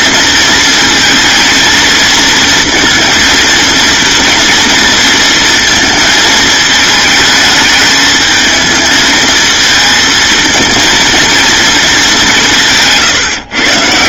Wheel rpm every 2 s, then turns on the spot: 230, 230, 230, 220, 220, 230, 180.
none